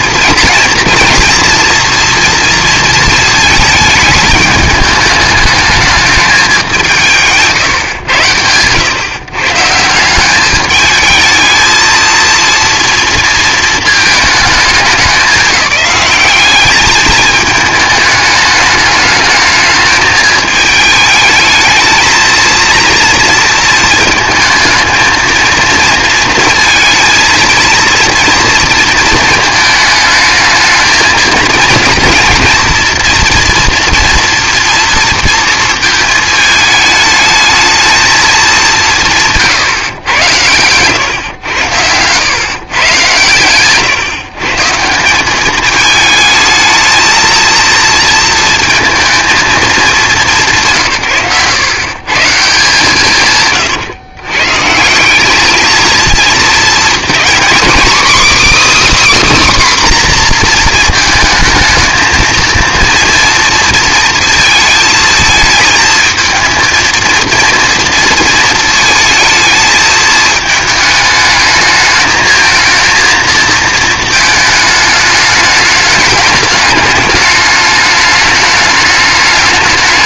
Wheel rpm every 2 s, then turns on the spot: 240, 230, 210, 190, 110, 210, 230, 200, 200, 210, 220, 230, 220, 220, 230, 220, 230, 230, 210, 190, 110, 120, 170, 220, 230, 170, 150, 150, 230, 310, 230, 230, 220, 220, 230, 220, 220, 220, 210, 210.
none